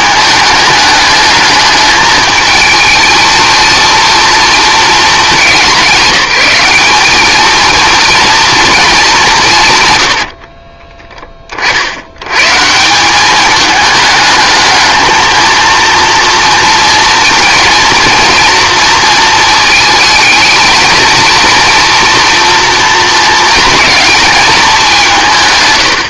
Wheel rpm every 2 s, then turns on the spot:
210, 220, 220, 190, 240, 40, 140, 220, 230, 230, 220, 230, 210.
10-12